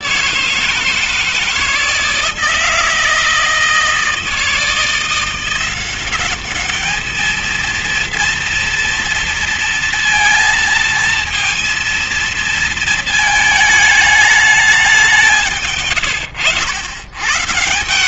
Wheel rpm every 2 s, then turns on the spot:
160, 160, 160, 200, 230, 230, 230, 210, 100.
none